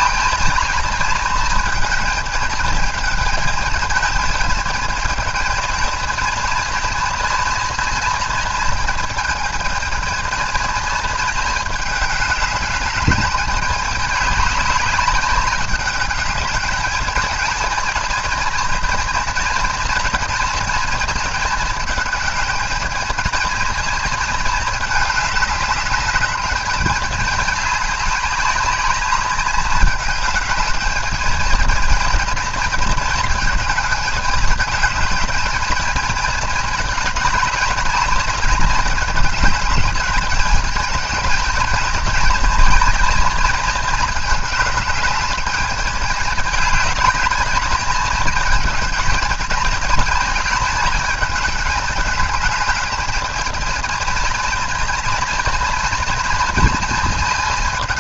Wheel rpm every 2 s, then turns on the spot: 220, 220, 220, 230, 230, 220, 210, 200, 210, 220, 230, 220, 220, 210, 200, 210, 230, 210, 220, 220, 220, 220, 210, 210, 220, 220, 210, 230, 220.
none